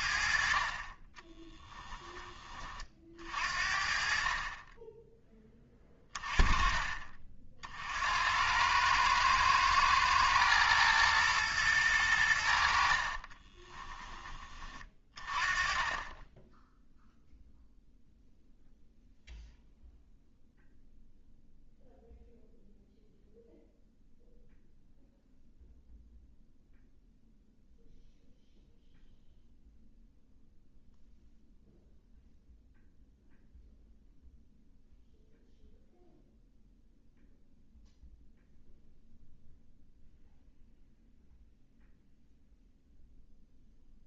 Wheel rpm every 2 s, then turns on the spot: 40, 30, 20, 20, 100, 110, 60, 20, 0, 0, 0, 0, 0, 0, 0, 0, 0, 0, 0, 0, 0, 0.
12-14